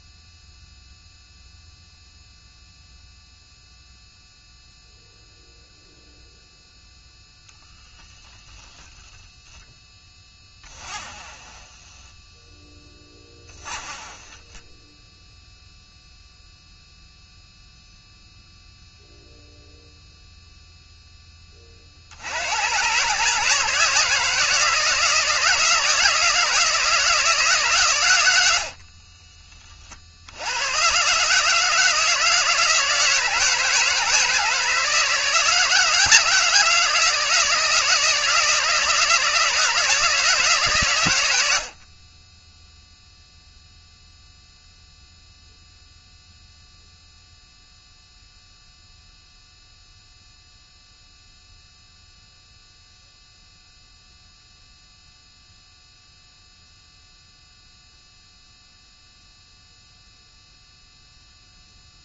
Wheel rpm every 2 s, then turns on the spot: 0, 0, 0, 0, 20, 20, 10, 10, 0, 0, 0, 100, 170, 160, 60, 100, 160, 160, 160, 160, 150, 10, 0, 0, 0, 0, 0, 0, 0, 0, 0.
10-12 28-30